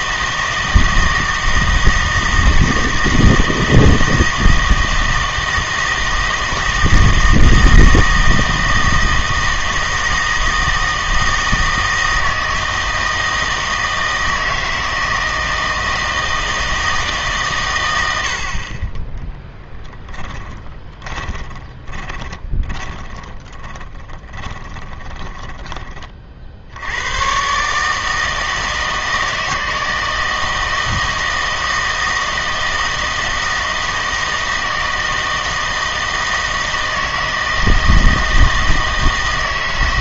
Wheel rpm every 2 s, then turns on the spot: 160, 160, 160, 160, 160, 160, 160, 160, 160, 30, 10, 20, 20, 70, 160, 160, 160, 160, 160, 160.
20-26